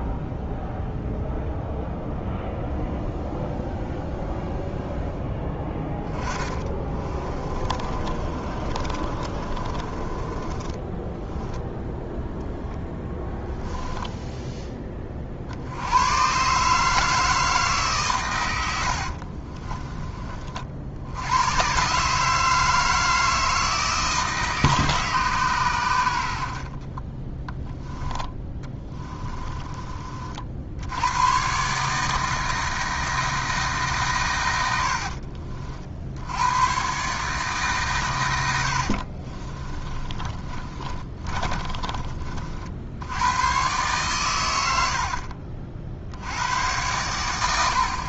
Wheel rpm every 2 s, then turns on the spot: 0, 0, 0, 20, 30, 20, 0, 20, 150, 80, 60, 160, 150, 60, 20, 60, 160, 80, 120, 70, 30, 70, 80, 100.
6-12 18-20 26-30 38-42 44-46